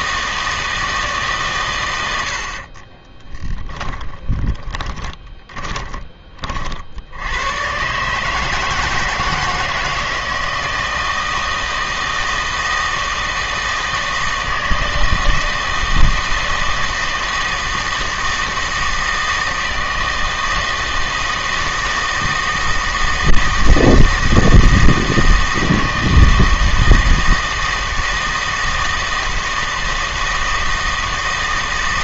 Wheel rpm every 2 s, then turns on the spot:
160, 40, 20, 50, 160, 160, 160, 160, 160, 160, 160, 160, 160, 160, 160, 160.
2-6